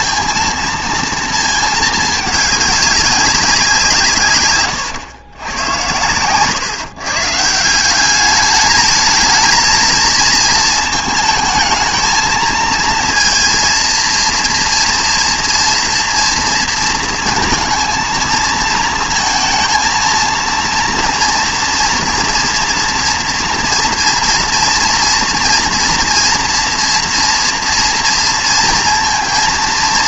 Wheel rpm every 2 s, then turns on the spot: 230, 200, 120, 140, 210, 220, 230, 240, 230, 220, 230, 240, 230, 230, 230.
none